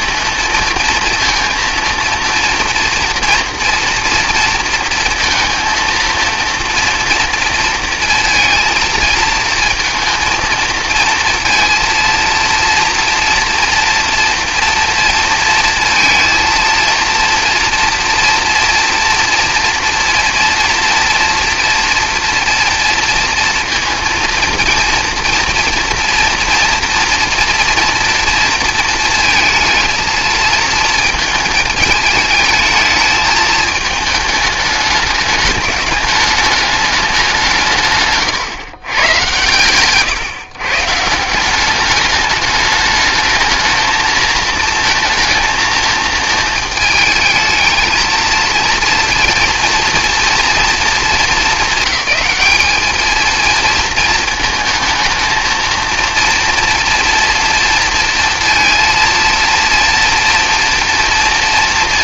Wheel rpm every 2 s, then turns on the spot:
230, 240, 230, 230, 230, 230, 230, 230, 230, 230, 240, 230, 230, 240, 230, 230, 220, 220, 210, 120, 150, 210, 230, 220, 230, 220, 210, 220, 230, 230, 230.
none